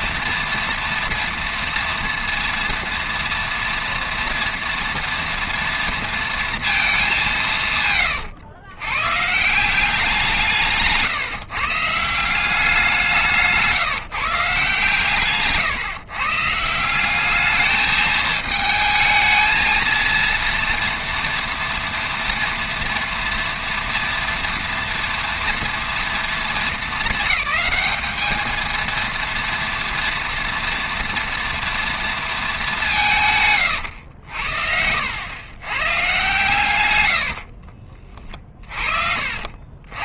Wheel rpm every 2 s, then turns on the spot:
230, 230, 240, 230, 110, 170, 180, 150, 150, 220, 230, 230, 230, 220, 220, 230, 210, 70, 140, 40.
34-36 38-40